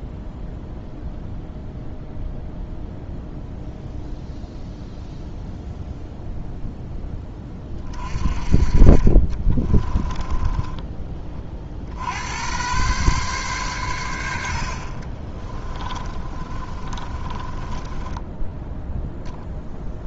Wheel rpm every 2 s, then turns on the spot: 0, 0, 0, 10, 40, 20, 120, 50, 30, 0.
10-12 14-18